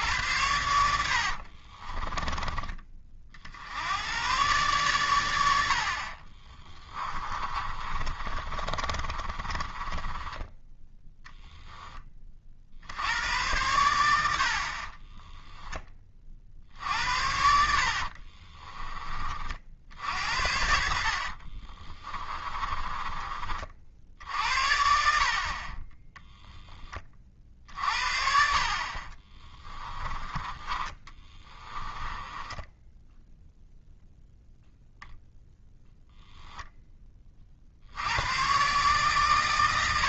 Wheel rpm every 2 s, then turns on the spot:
80, 40, 120, 20, 30, 10, 60, 50, 60, 20, 60, 20, 60, 30, 40, 20, 10, 0, 10, 130.
6-10 14-16 20-24 30-34